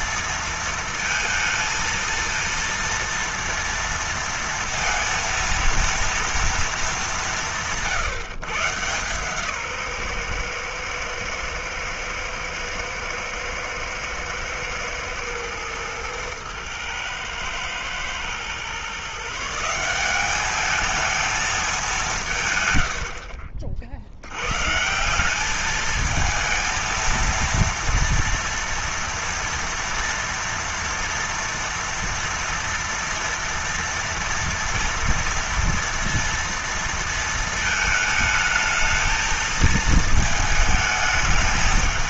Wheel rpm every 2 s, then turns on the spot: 230, 230, 230, 210, 140, 120, 120, 120, 110, 140, 210, 100, 160, 230, 230, 230, 230, 230, 230, 220, 210.
none